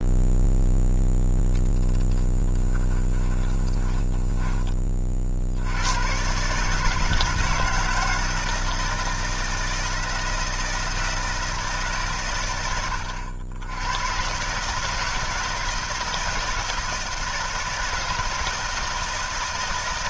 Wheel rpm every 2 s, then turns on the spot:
0, 10, 30, 150, 160, 160, 100, 160, 160, 160.
2-4